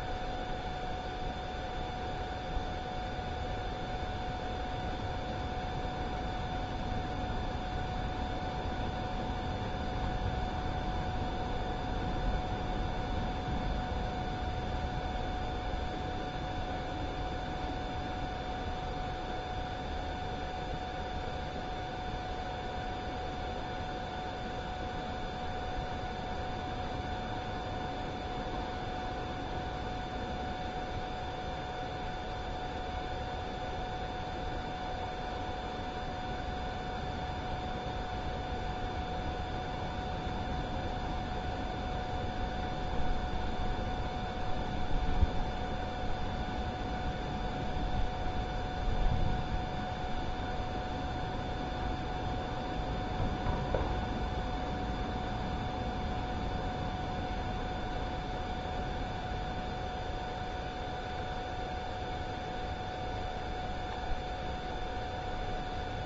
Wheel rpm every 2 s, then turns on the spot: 0, 0, 0, 0, 0, 0, 0, 0, 0, 0, 0, 0, 0, 0, 0, 0, 0, 0, 0, 0, 0, 0, 0, 0, 0, 0, 0, 0, 0, 0, 0, 0, 0.
none